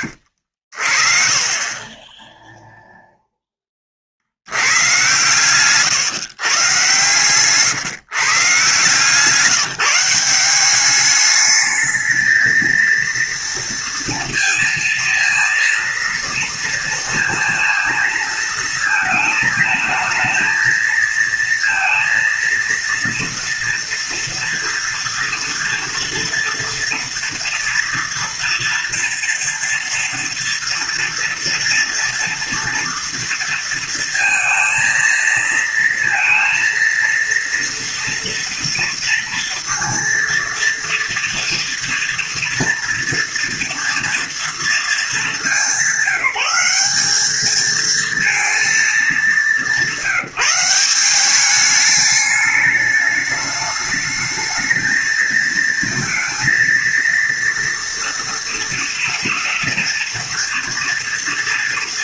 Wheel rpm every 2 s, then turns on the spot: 60, 0, 90, 130, 150, 190, 220, 230, 230, 220, 220, 230, 230, 230, 230, 230, 230, 230, 230, 230, 230, 230, 230, 190, 230, 180, 210, 220, 230, 230, 230.
none